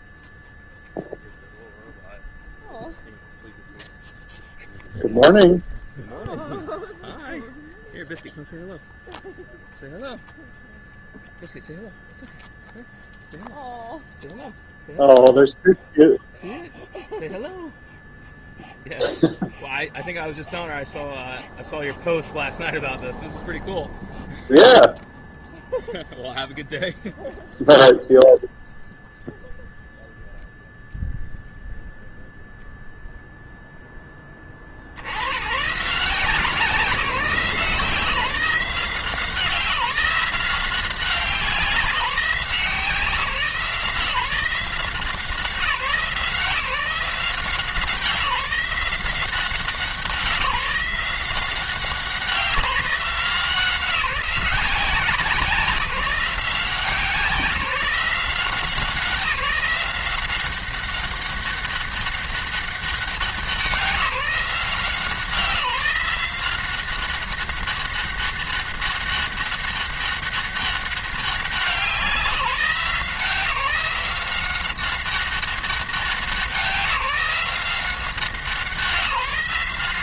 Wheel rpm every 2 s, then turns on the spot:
0, 0, 0, 0, 0, 0, 0, 0, 0, 0, 0, 0, 0, 0, 0, 0, 0, 50, 190, 180, 180, 170, 170, 170, 170, 180, 170, 180, 170, 170, 190, 200, 170, 180, 200, 200, 170, 190, 190, 170.
none